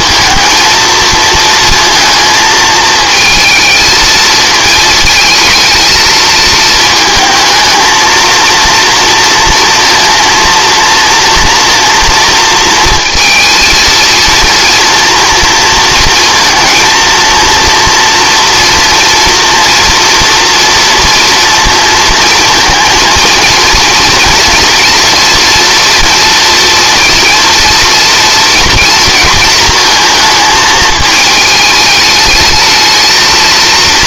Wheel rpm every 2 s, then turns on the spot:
230, 220, 220, 220, 230, 230, 230, 230, 230, 230, 230, 230, 240, 230, 230, 220, 220.
none